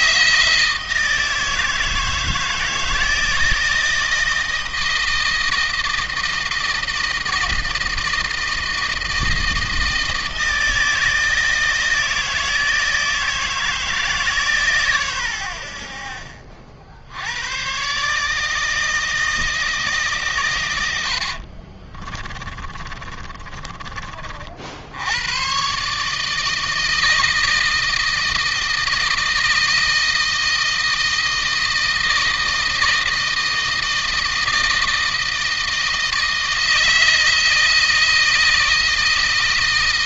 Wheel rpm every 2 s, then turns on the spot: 160, 160, 160, 160, 160, 160, 160, 130, 70, 160, 100, 30, 80, 160, 160, 160, 160, 160, 160, 160.
20-24